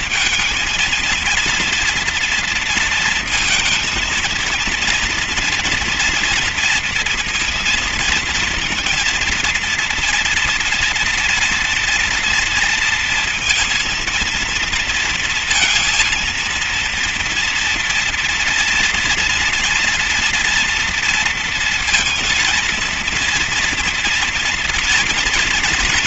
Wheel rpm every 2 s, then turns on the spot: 230, 230, 240, 230, 230, 240, 230, 230, 230, 230, 230, 230, 230.
none